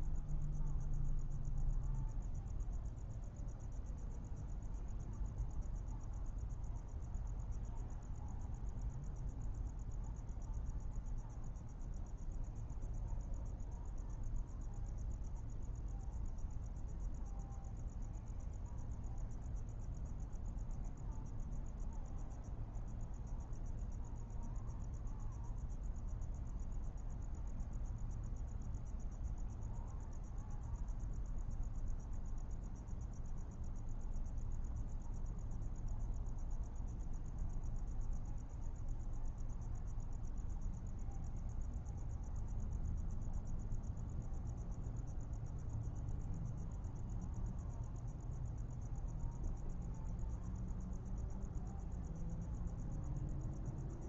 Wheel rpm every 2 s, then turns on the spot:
0, 0, 0, 0, 0, 0, 0, 0, 0, 0, 0, 0, 0, 0, 0, 0, 0, 0, 0, 0, 0, 0, 0, 0, 0, 0, 0.
none